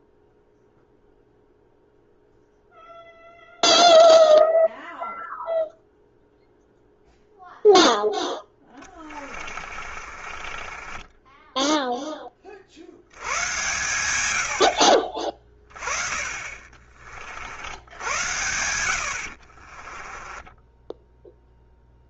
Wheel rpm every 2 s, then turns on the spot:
0, 0, 0, 0, 10, 20, 40, 80, 40, 80, 10.
8-12 20-22